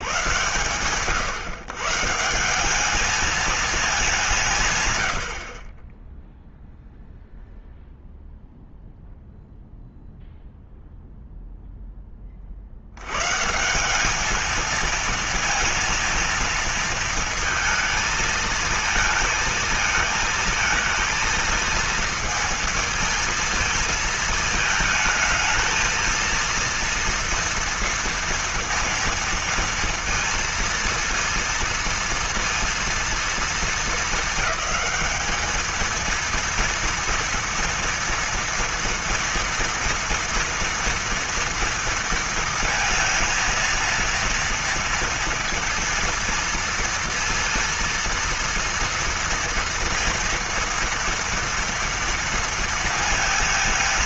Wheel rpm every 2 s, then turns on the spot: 110, 170, 150, 0, 0, 0, 50, 220, 230, 220, 220, 220, 220, 230, 230, 230, 230, 210, 230, 230, 230, 230, 230, 230, 230, 230, 230.
none